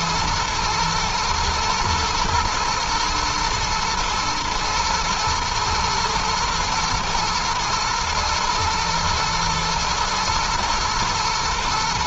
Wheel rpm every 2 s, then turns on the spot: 110, 120, 120, 110, 110, 110.
none